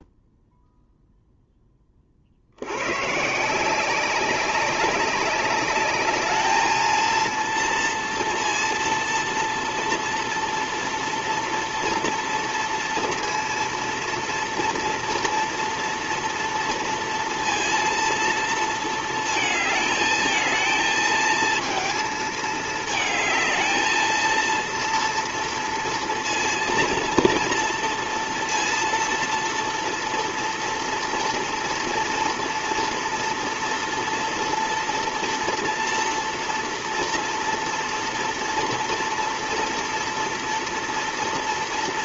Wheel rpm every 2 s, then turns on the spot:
0, 70, 190, 210, 230, 230, 230, 230, 230, 230, 220, 220, 230, 230, 230, 230, 230, 230, 230, 230, 230.
none